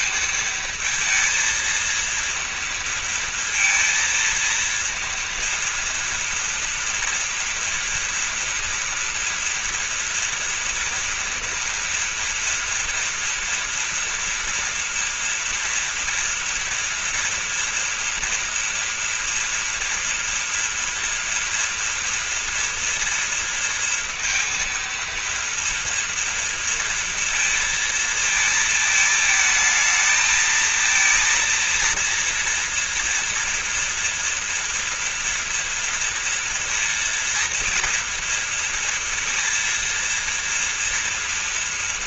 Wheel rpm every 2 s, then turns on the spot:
220, 230, 230, 230, 230, 240, 240, 240, 230, 240, 230, 230, 230, 230, 220, 230, 230, 230, 230, 230, 230.
none